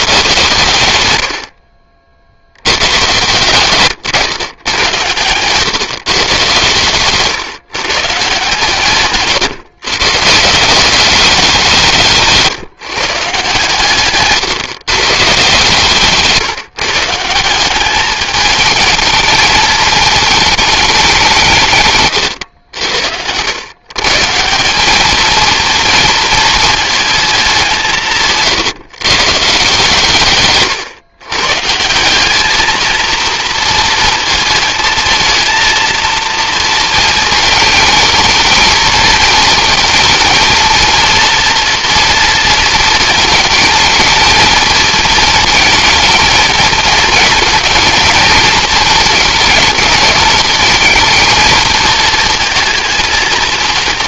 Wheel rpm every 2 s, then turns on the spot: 110, 120, 110, 120, 140, 190, 150, 140, 160, 220, 190, 90, 210, 220, 150, 120, 220, 220, 220, 220, 230, 220, 230, 220, 220, 220, 230.
none